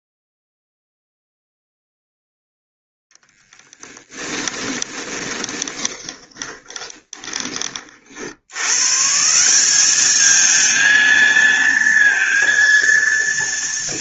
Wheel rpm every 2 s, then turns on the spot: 0, 10, 20, 20, 110, 220, 230.
4-8